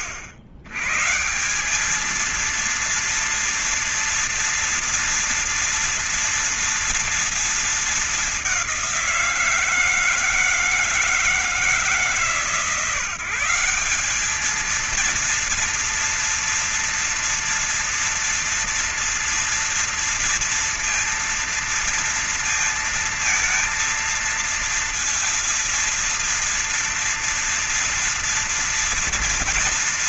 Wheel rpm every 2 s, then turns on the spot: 110, 230, 230, 230, 190, 160, 150, 220, 230, 230, 230, 230, 230, 230, 230.
none